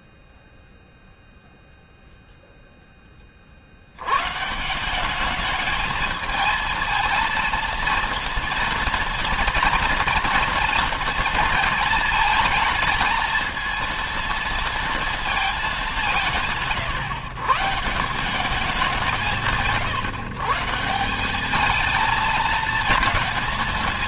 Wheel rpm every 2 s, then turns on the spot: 0, 10, 170, 220, 230, 230, 220, 230, 150, 190, 150, 220.
none